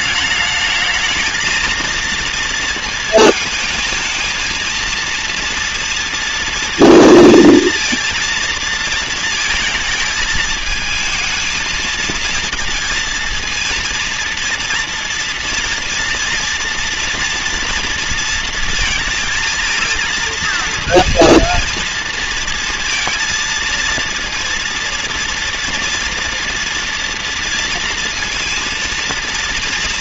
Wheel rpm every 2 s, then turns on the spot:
220, 220, 230, 230, 230, 220, 230, 230, 230, 220, 230, 230, 230, 240, 230.
none